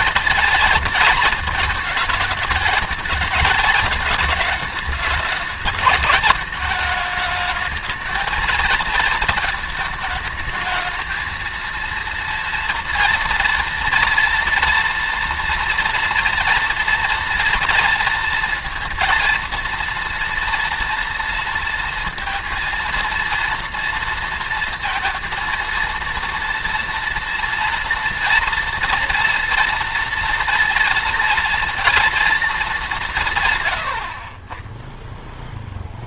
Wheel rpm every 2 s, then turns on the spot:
230, 220, 210, 210, 230, 220, 230, 230, 230, 230, 230, 230, 230, 230, 230, 230, 220, 30.
none